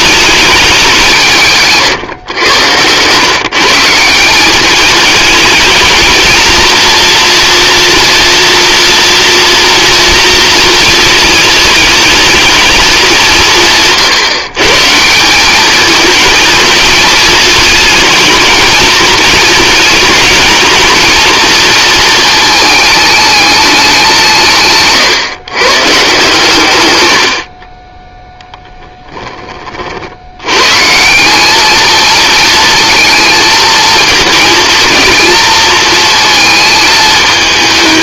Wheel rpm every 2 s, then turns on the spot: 190, 120, 210, 230, 240, 220, 200, 150, 220, 220, 230, 220, 150, 100, 10, 140, 230, 230, 220.
none